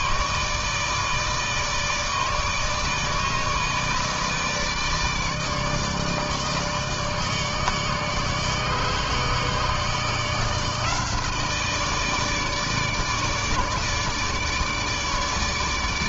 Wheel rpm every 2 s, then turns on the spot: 160, 160, 160, 150, 150, 160, 160, 150.
none